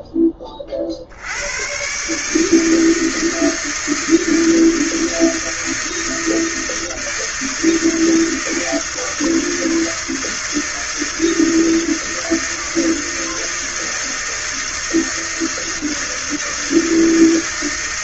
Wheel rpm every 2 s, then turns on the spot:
30, 160, 160, 160, 160, 160, 160, 160, 160.
none